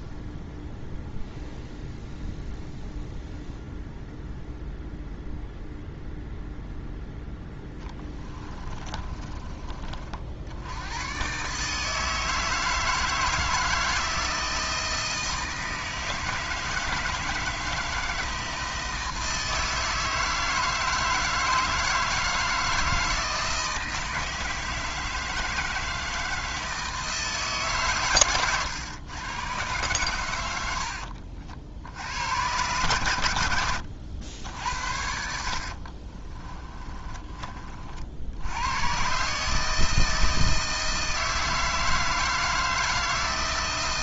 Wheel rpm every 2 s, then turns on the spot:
0, 0, 0, 0, 20, 100, 160, 160, 160, 160, 160, 160, 160, 160, 120, 70, 110, 70, 20, 130, 160, 160.
8-10 36-38